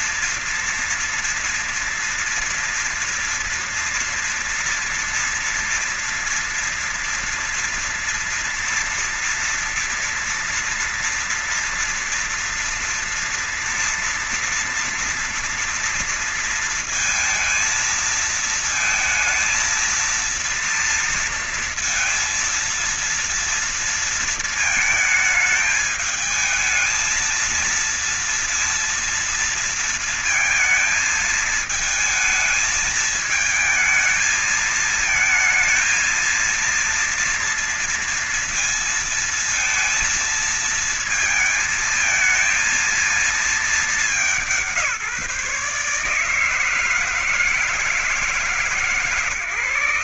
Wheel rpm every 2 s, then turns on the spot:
230, 230, 230, 230, 230, 230, 230, 230, 230, 230, 230, 230, 230, 220, 230, 230, 220, 220, 230, 230, 230, 220, 190, 160, 150.
none